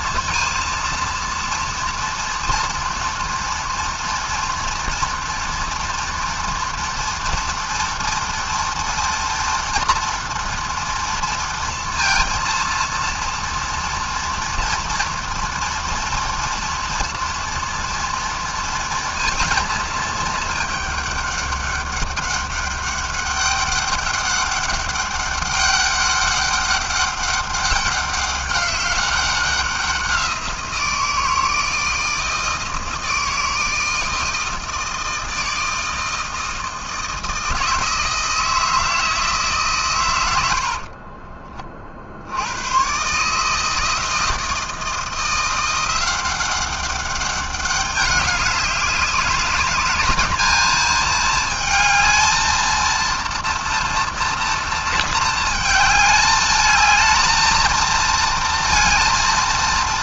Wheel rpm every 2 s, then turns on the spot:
230, 240, 230, 230, 230, 230, 230, 230, 230, 230, 200, 200, 200, 200, 190, 170, 160, 160, 160, 160, 40, 140, 170, 200, 200, 220, 230, 220, 220, 230.
40-42